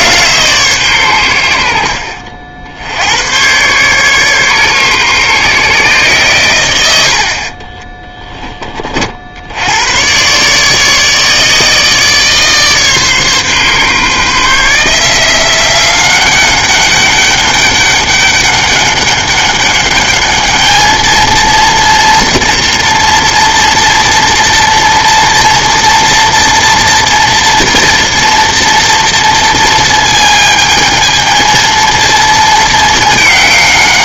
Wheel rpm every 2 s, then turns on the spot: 140, 70, 140, 110, 20, 140, 150, 150, 200, 200, 210, 230, 230, 230, 230, 220, 220.
none